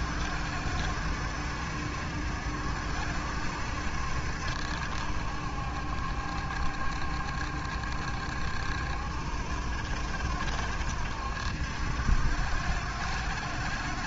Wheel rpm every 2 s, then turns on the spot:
70, 60, 70, 70, 70, 70, 60.
none